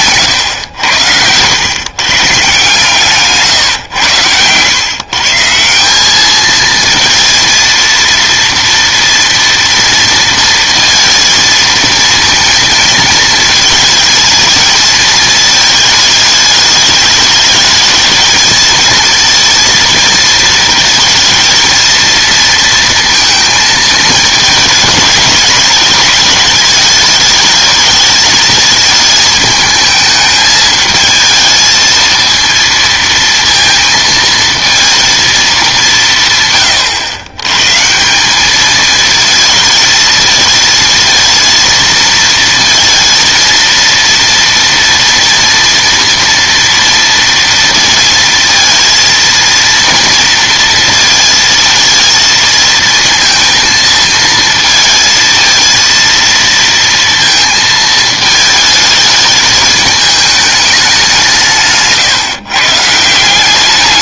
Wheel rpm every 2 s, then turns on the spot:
100, 130, 120, 220, 230, 230, 230, 220, 210, 220, 230, 230, 220, 210, 220, 220, 230, 230, 110, 210, 220, 230, 240, 230, 230, 230, 230, 220, 230, 220, 210, 150.
none